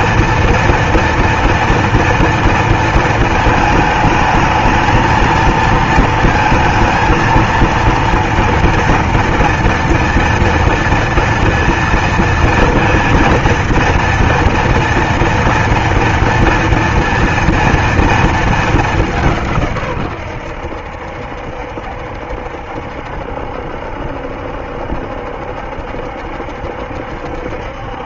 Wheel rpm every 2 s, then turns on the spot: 230, 240, 220, 220, 230, 230, 230, 230, 230, 230, 110, 70, 70, 70.
none